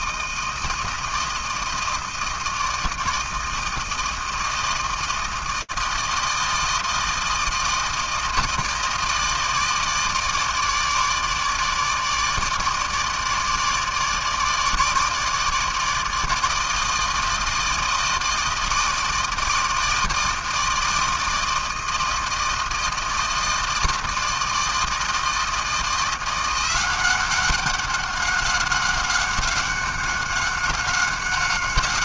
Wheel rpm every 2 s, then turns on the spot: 160, 160, 160, 160, 160, 160, 150, 150, 160, 160, 160, 160, 160, 180, 200, 190.
none